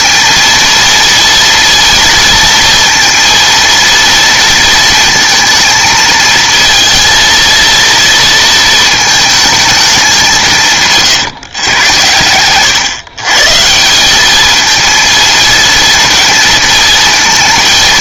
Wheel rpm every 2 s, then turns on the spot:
230, 230, 230, 220, 230, 170, 120, 220, 220.
none